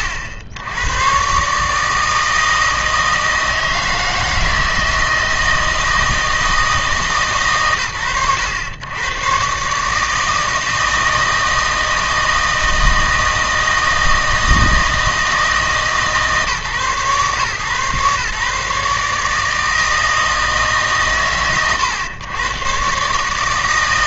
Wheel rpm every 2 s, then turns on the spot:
90, 160, 160, 160, 110, 160, 160, 160, 140, 150, 140, 130.
none